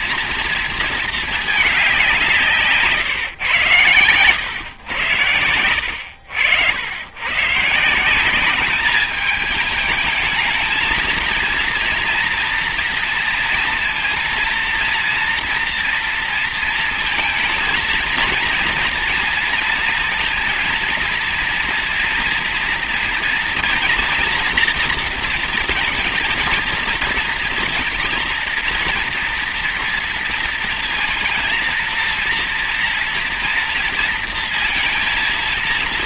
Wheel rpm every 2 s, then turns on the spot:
220, 140, 100, 100, 200, 220, 230, 230, 230, 230, 230, 230, 230, 230, 230, 230, 230, 230.
none